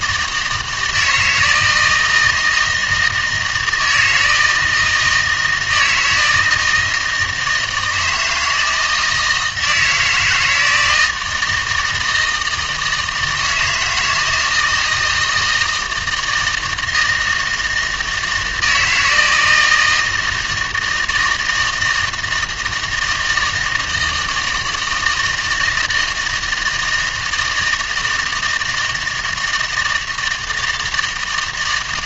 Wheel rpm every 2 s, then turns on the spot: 160, 160, 160, 160, 160, 160, 160, 160, 160, 160, 160, 160, 160, 160, 160, 160.
none